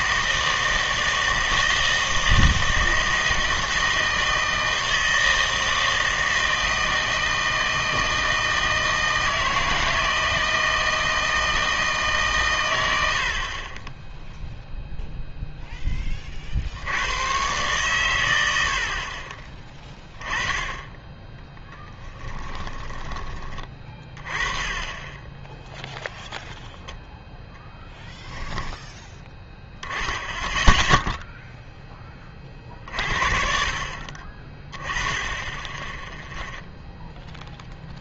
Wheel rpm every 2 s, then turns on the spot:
160, 160, 160, 160, 160, 160, 100, 0, 70, 80, 20, 20, 20, 0, 10, 10, 40, 20, 0.
22-24